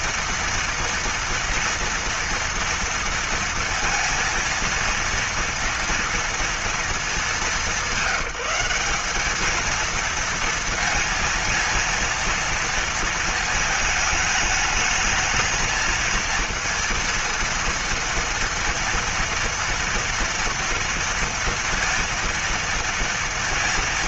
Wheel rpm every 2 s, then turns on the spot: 230, 230, 230, 230, 190, 230, 230, 210, 230, 230, 230, 230.
none